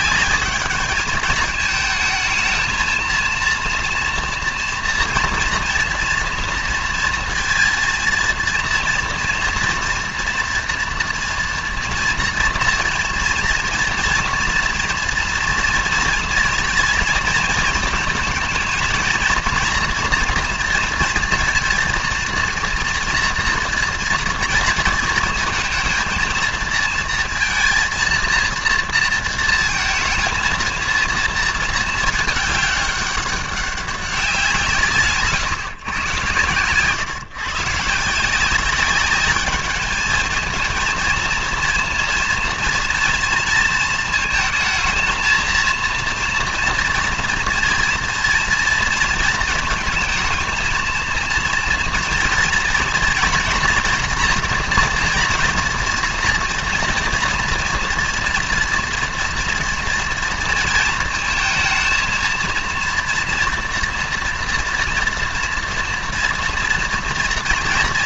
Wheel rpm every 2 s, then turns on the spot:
210, 220, 230, 230, 230, 230, 230, 230, 230, 220, 230, 230, 230, 230, 230, 230, 210, 160, 120, 190, 220, 230, 220, 230, 240, 230, 230, 240, 240, 230, 230, 230, 240, 230.
none